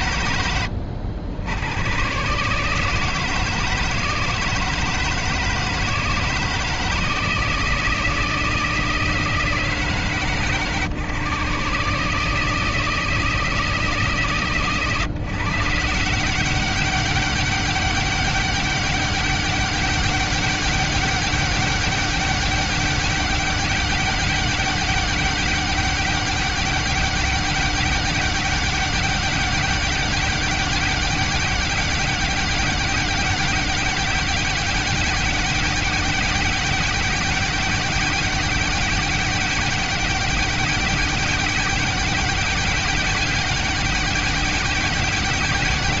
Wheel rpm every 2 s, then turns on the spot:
90, 140, 160, 160, 160, 140, 160, 140, 200, 200, 200, 200, 200, 200, 200, 200, 200, 200, 200, 200, 200, 200, 200.
none